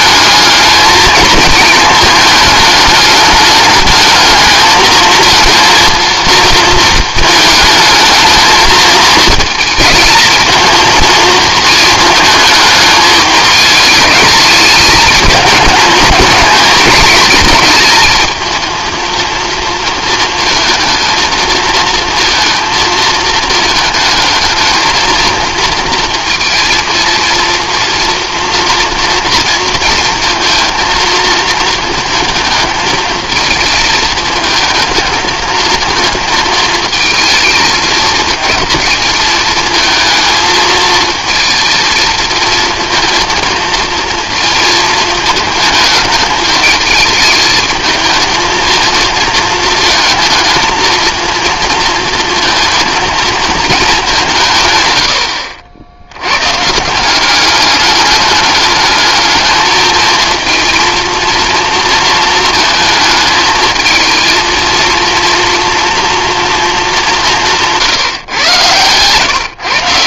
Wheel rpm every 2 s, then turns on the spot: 220, 210, 220, 220, 220, 220, 220, 210, 220, 230, 230, 230, 220, 230, 230, 230, 220, 220, 230, 220, 220, 230, 220, 210, 220, 230, 230, 90, 170, 210, 230, 220, 230, 190, 120.
none